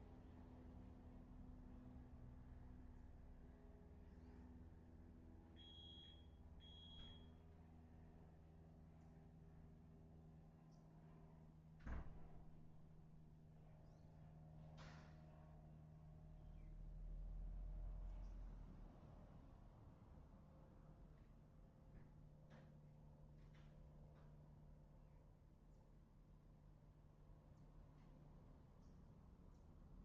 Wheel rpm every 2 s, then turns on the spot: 0, 0, 0, 0, 0, 0, 0, 0, 0, 0, 0, 0, 0, 0, 0.
none